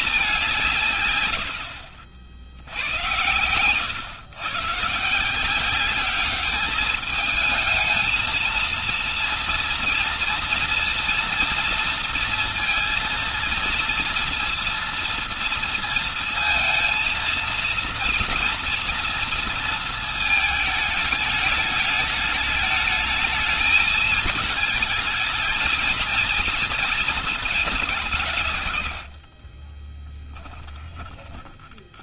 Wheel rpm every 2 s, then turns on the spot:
180, 80, 130, 210, 230, 230, 230, 230, 230, 230, 220, 220, 220, 230, 150, 10.
30-32